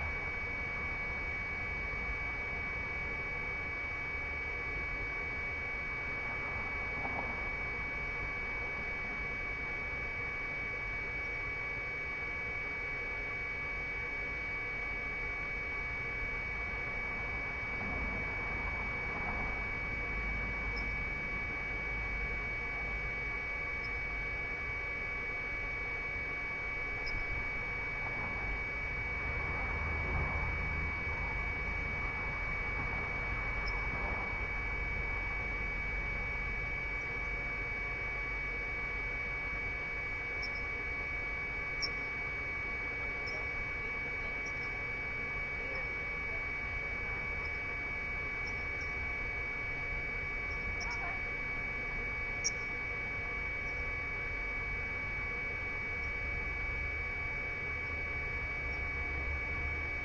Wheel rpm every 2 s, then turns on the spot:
0, 0, 0, 0, 0, 0, 0, 0, 0, 0, 0, 0, 0, 0, 0, 0, 0, 0, 0, 0, 0, 0, 0, 0, 0, 0, 0, 0, 0, 0.
none